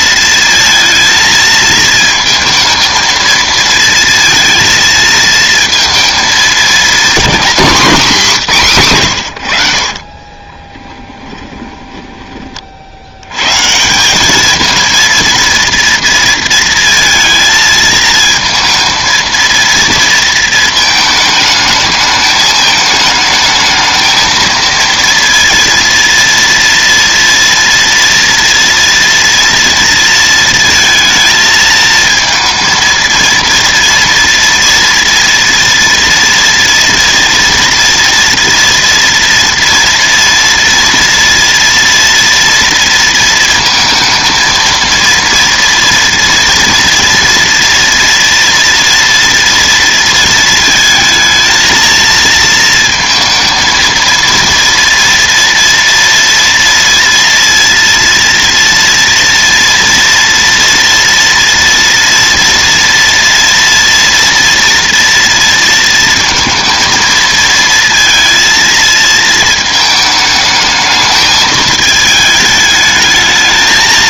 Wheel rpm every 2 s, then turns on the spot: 230, 220, 230, 220, 180, 20, 30, 220, 230, 230, 220, 220, 230, 230, 230, 230, 230, 230, 230, 230, 230, 230, 230, 230, 240, 230, 230, 230, 230, 230, 230, 230, 230, 230, 230, 220, 210.
10-12